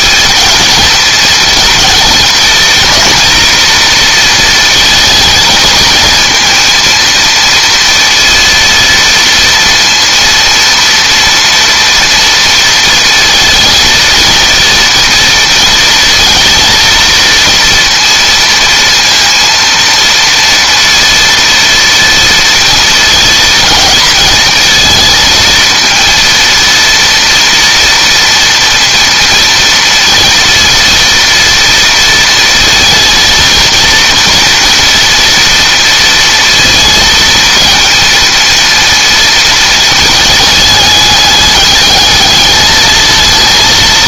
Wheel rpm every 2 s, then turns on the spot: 220, 230, 230, 230, 230, 230, 230, 230, 230, 230, 230, 230, 220, 230, 230, 230, 230, 240, 230, 230, 210, 220.
none